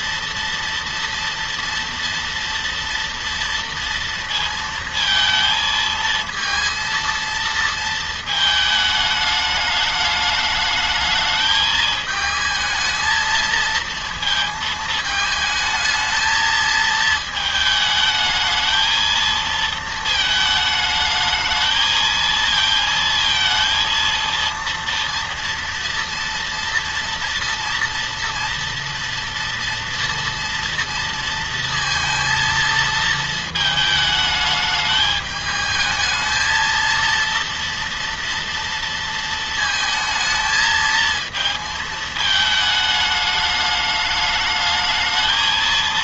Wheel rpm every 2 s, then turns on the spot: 240, 230, 230, 230, 210, 210, 220, 220, 220, 220, 220, 230, 230, 230, 240, 230, 220, 210, 230, 230, 220, 220, 220.
none